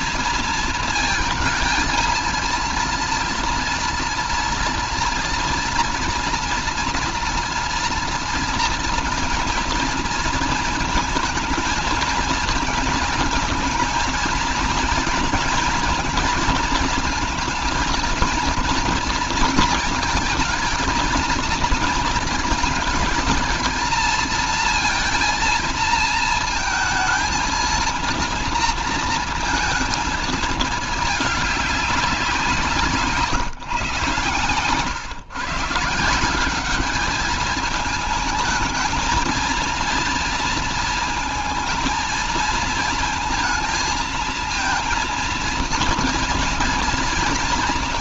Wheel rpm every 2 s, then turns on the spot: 230, 230, 240, 230, 230, 230, 220, 220, 230, 230, 220, 220, 230, 230, 230, 220, 180, 140, 200, 220, 230, 230, 230, 230.
none